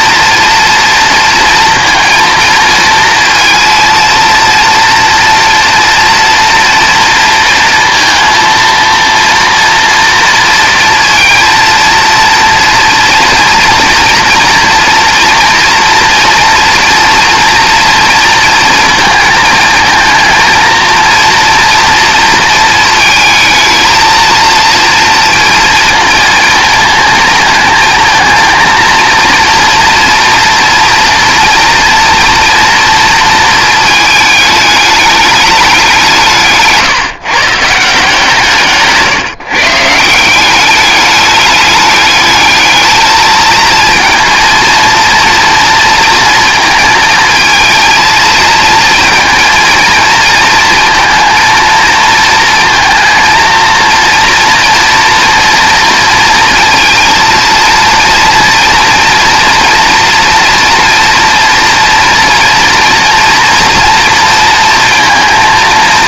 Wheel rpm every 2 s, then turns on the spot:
230, 230, 230, 230, 230, 230, 230, 230, 230, 220, 230, 220, 230, 230, 230, 230, 230, 210, 140, 150, 200, 220, 230, 220, 220, 230, 230, 230, 230, 230, 230, 230, 230.
none